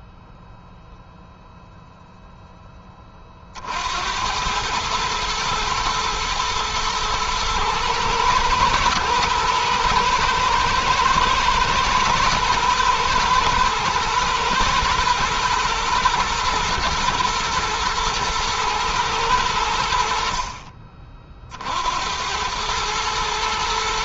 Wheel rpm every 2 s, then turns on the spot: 0, 20, 110, 110, 120, 120, 120, 120, 110, 110, 40, 110.
none